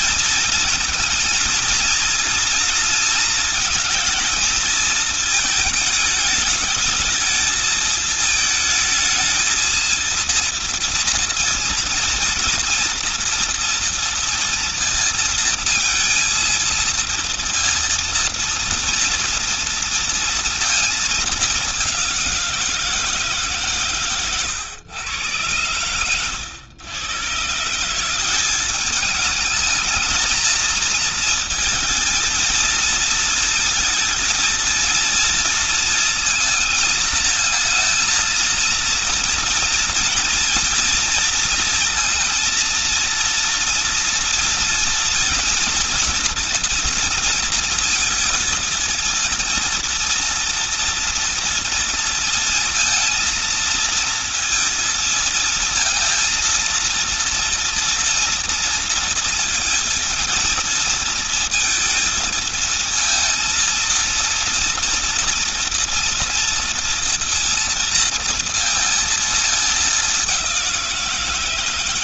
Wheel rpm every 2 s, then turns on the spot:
220, 230, 220, 220, 220, 230, 230, 230, 230, 230, 220, 170, 120, 120, 200, 220, 230, 230, 220, 230, 230, 230, 240, 230, 230, 230, 230, 230, 230, 230, 230, 220, 230, 230, 230, 180.
none